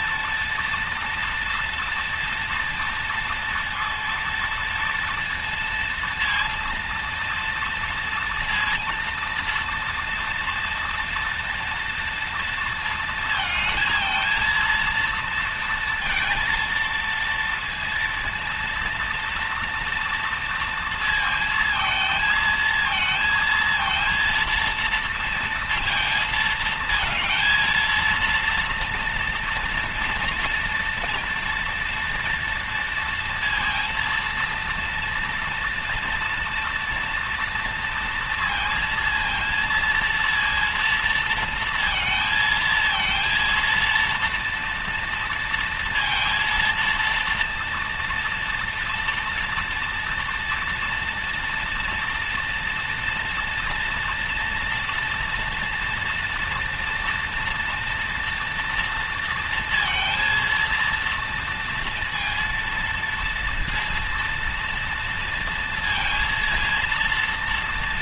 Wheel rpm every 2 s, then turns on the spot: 230, 230, 230, 230, 230, 230, 230, 230, 230, 230, 230, 230, 230, 220, 230, 230, 230, 230, 240, 230, 230, 230, 230, 230, 230, 240, 230, 240, 230, 230, 230, 230, 230, 230.
none